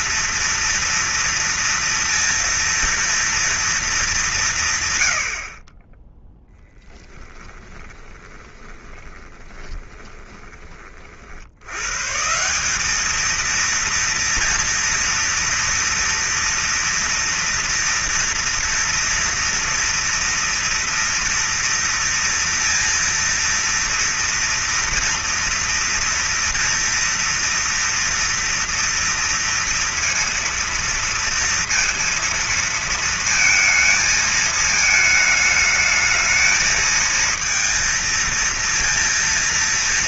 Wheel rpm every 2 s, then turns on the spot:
230, 230, 180, 10, 20, 20, 150, 230, 230, 230, 230, 230, 230, 230, 230, 230, 230, 220, 220, 230.
8-12